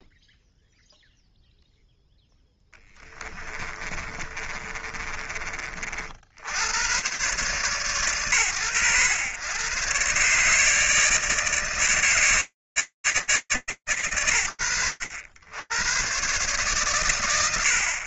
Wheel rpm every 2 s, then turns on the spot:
0, 0, 30, 90, 110, 140, 150, 70, 110.
4-6